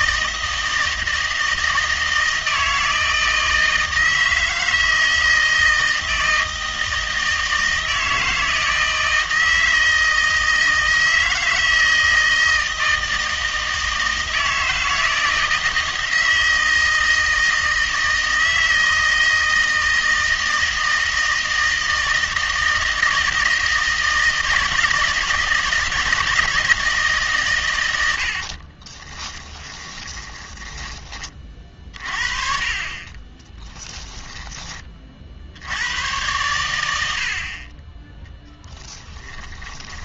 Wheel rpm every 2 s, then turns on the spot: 160, 160, 160, 160, 160, 160, 160, 160, 160, 160, 160, 160, 160, 160, 60, 10, 40, 20, 90, 10.
28-32 38-40